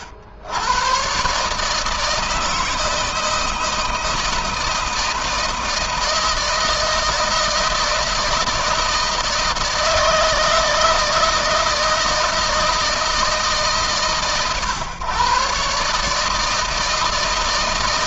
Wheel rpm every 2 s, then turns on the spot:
90, 160, 160, 160, 160, 160, 160, 130, 150.
none